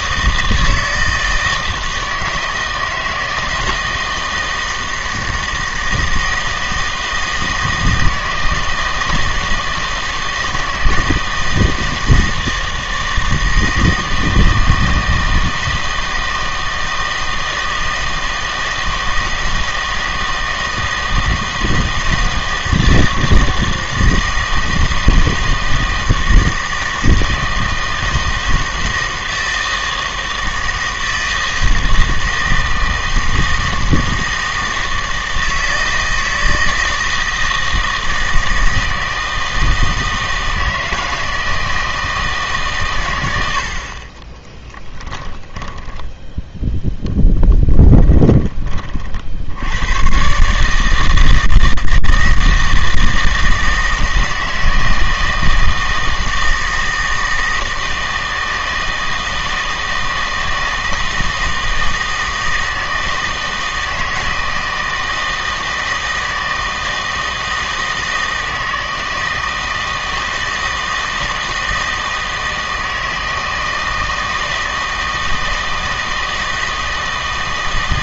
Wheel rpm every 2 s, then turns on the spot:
160, 160, 160, 160, 160, 160, 160, 160, 160, 160, 160, 160, 160, 160, 160, 160, 160, 160, 160, 160, 160, 140, 20, 0, 30, 150, 160, 160, 160, 160, 160, 160, 160, 160, 160, 160, 160, 160, 160.
44-46